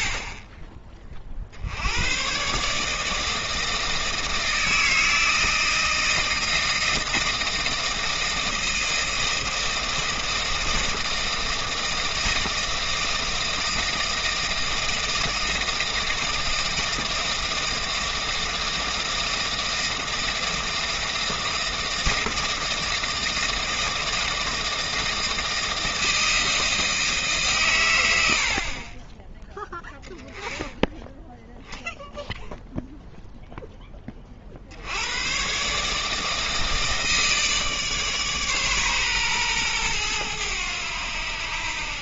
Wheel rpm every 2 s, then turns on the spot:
20, 140, 160, 160, 160, 160, 160, 160, 160, 160, 160, 160, 160, 160, 60, 20, 0, 60, 160, 140, 100.
none